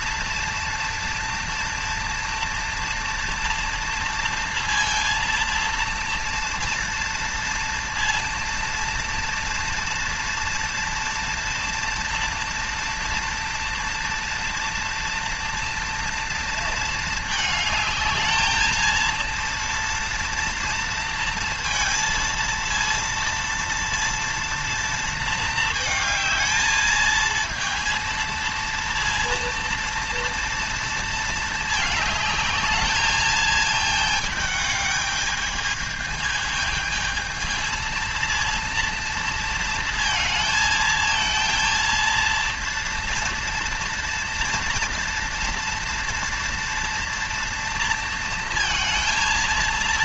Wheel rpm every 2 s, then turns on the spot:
230, 230, 230, 230, 230, 230, 230, 230, 230, 220, 230, 230, 230, 220, 230, 230, 220, 220, 220, 230, 220, 230, 230, 230, 230.
none